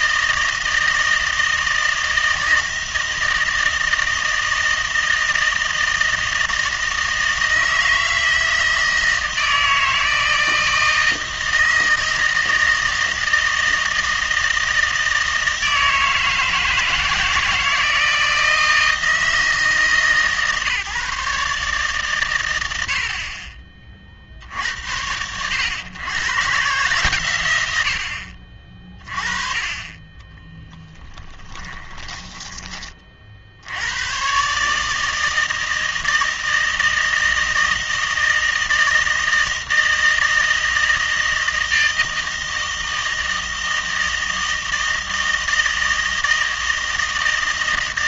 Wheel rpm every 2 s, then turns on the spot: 160, 160, 160, 160, 160, 160, 160, 160, 160, 160, 150, 80, 70, 130, 40, 20, 20, 140, 160, 160, 160, 160, 160, 160.
30-32